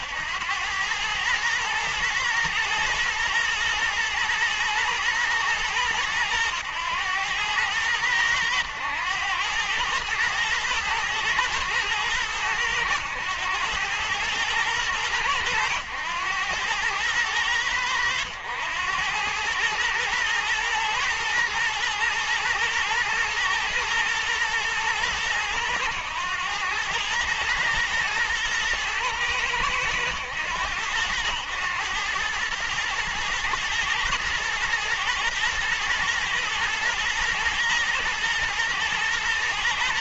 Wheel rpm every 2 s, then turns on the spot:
100, 120, 110, 100, 100, 110, 100, 110, 100, 90, 120, 110, 110, 110, 110, 100, 110, 110, 120, 110.
none